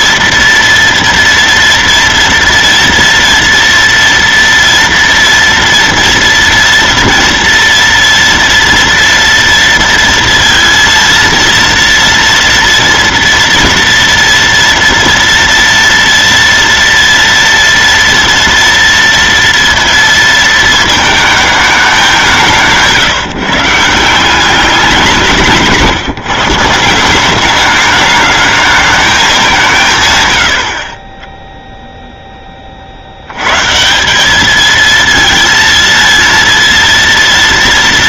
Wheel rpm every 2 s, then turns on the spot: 230, 230, 230, 230, 230, 230, 230, 230, 230, 230, 220, 160, 190, 180, 220, 30, 30, 220, 230.
none